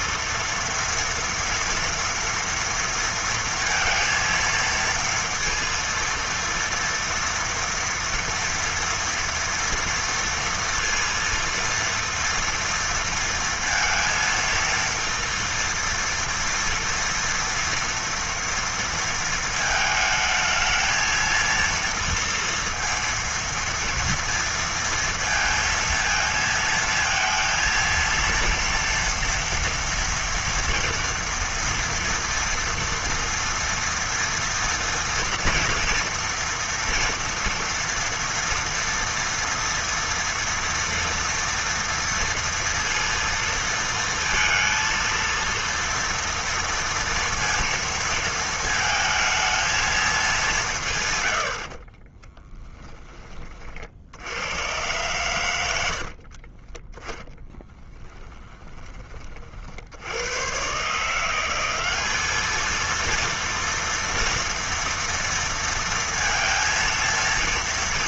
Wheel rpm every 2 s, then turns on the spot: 230, 230, 230, 230, 230, 230, 230, 230, 230, 230, 220, 230, 230, 220, 230, 230, 240, 240, 230, 230, 230, 230, 230, 230, 220, 180, 20, 100, 40, 10, 110, 220, 230, 230.
52-54 56-60